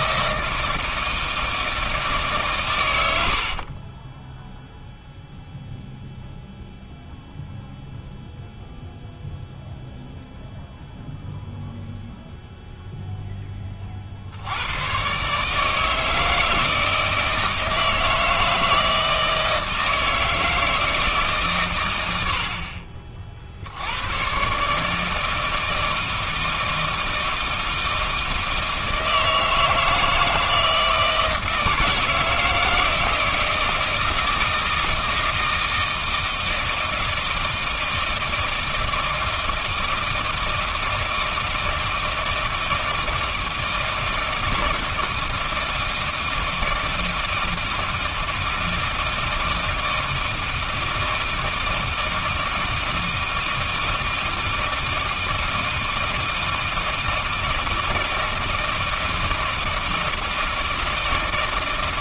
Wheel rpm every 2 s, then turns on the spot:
160, 110, 0, 0, 0, 0, 0, 110, 160, 160, 160, 40, 140, 160, 160, 160, 160, 160, 160, 160, 160, 160, 160, 160, 160, 160, 160, 160, 160, 160, 160.
none